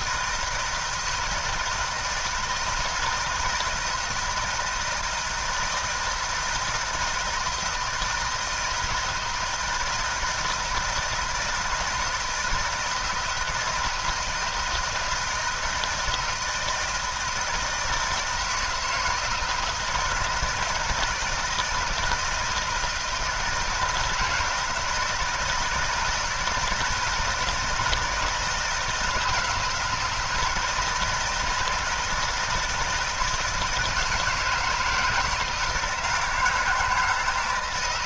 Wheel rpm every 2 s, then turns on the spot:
170, 160, 160, 160, 160, 160, 160, 160, 160, 160, 160, 160, 160, 160, 160, 160, 160, 160, 160.
none